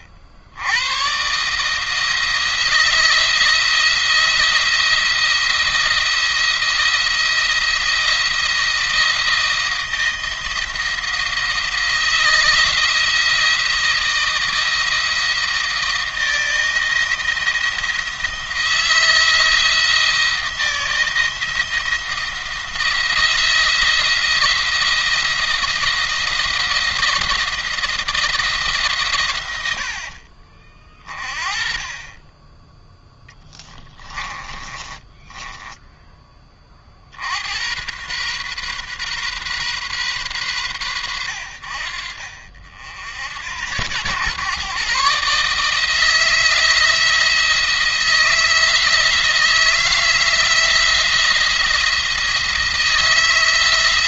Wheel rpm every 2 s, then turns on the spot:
90, 170, 170, 170, 170, 170, 170, 170, 170, 170, 170, 170, 170, 170, 150, 40, 10, 20, 40, 130, 120, 60, 130, 170, 160, 170, 160.
34-36